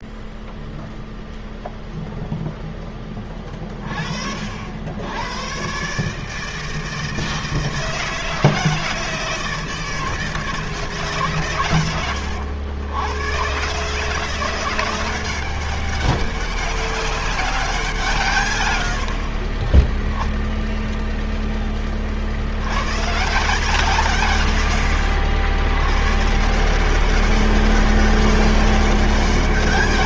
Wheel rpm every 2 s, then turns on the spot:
0, 10, 80, 160, 160, 150, 100, 180, 200, 90, 0, 120, 110, 180, 200.
none